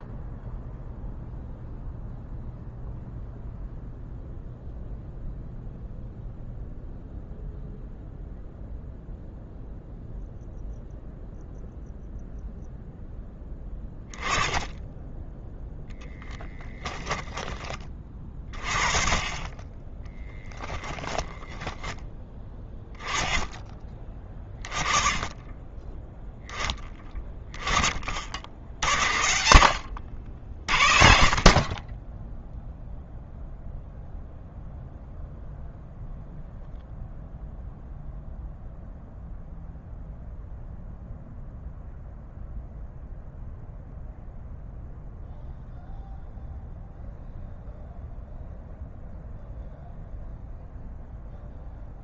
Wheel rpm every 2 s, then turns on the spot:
0, 0, 0, 0, 0, 0, 0, 10, 10, 30, 20, 10, 10, 10, 60, 70, 0, 0, 0, 0, 0, 0, 0, 0, 0, 0.
16-18